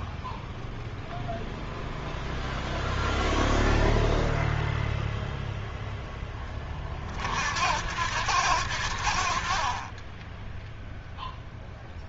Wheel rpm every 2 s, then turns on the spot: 0, 0, 0, 20, 90, 10.
none